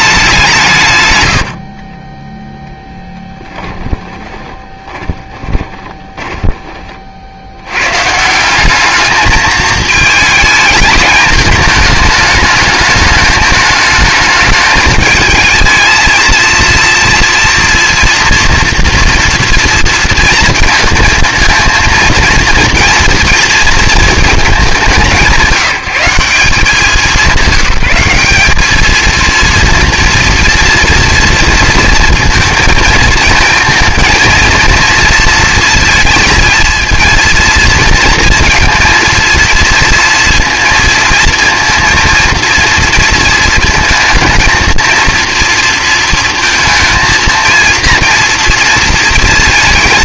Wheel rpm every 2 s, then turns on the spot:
150, 0, 10, 20, 190, 220, 210, 220, 230, 230, 230, 230, 210, 190, 210, 230, 230, 230, 230, 230, 230, 230, 230, 230, 230.
4-6